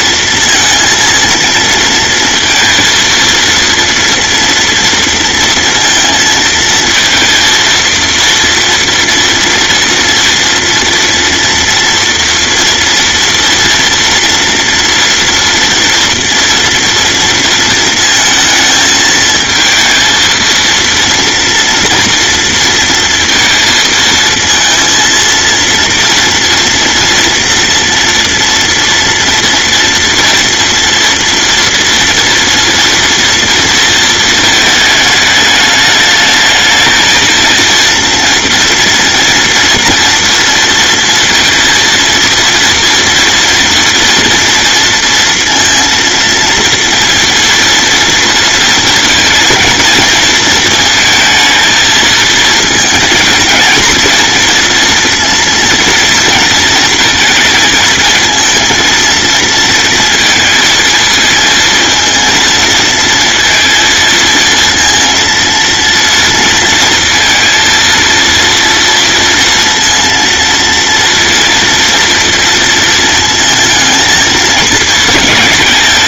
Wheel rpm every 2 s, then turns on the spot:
230, 230, 230, 230, 230, 230, 230, 230, 240, 220, 230, 230, 230, 230, 230, 230, 230, 220, 220, 230, 230, 230, 230, 230, 230, 230, 230, 240, 230, 230, 220, 230, 230, 230, 230, 230, 230, 220.
none